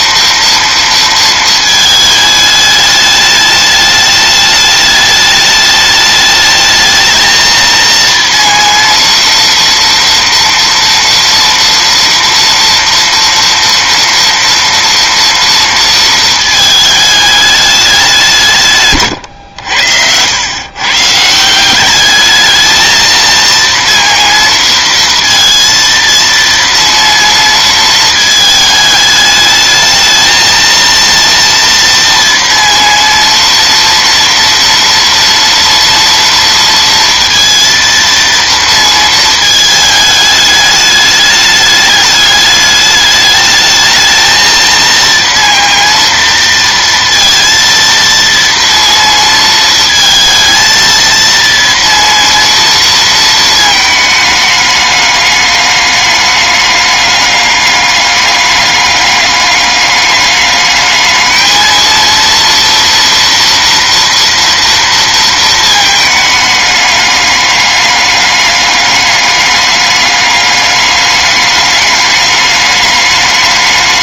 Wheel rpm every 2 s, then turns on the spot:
230, 210, 210, 220, 230, 230, 230, 230, 220, 140, 120, 220, 230, 230, 220, 230, 240, 230, 230, 230, 210, 210, 220, 230, 230, 220, 230, 210, 200, 200, 210, 230, 230, 210, 200, 200, 210.
none